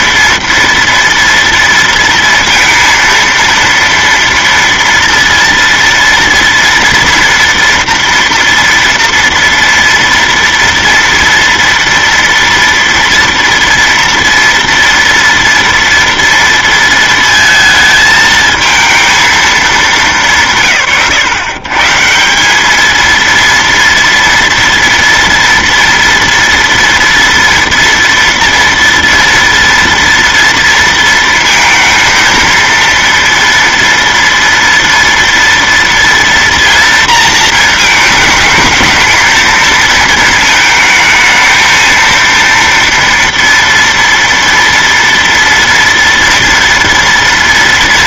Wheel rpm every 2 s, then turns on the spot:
230, 230, 230, 230, 230, 230, 240, 230, 230, 220, 150, 210, 230, 230, 230, 230, 230, 230, 230, 220, 220, 230, 230, 230.
none